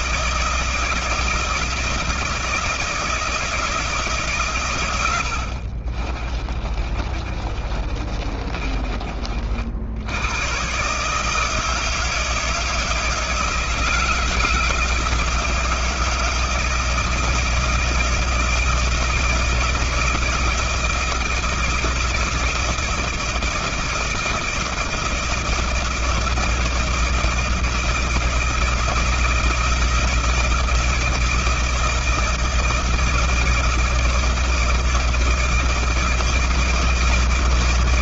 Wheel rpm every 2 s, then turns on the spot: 160, 160, 70, 30, 40, 150, 160, 170, 160, 170, 170, 170, 170, 160, 160, 170, 160, 160, 160.
4-8